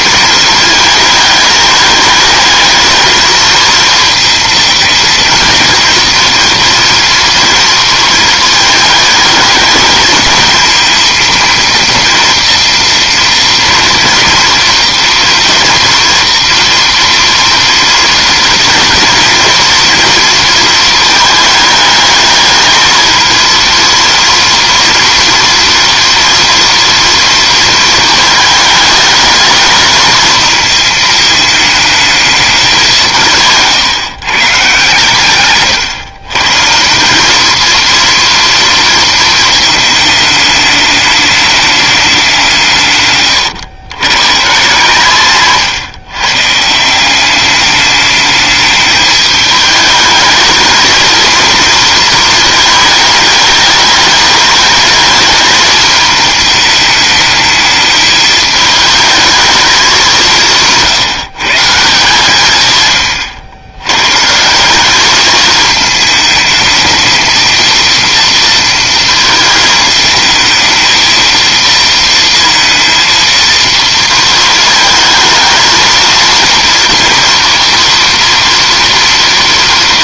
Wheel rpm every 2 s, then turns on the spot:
220, 220, 220, 230, 220, 220, 230, 230, 230, 230, 230, 220, 230, 230, 220, 220, 190, 130, 150, 230, 210, 160, 150, 150, 210, 220, 220, 210, 210, 220, 170, 140, 180, 220, 230, 220, 230, 220, 230, 230.
none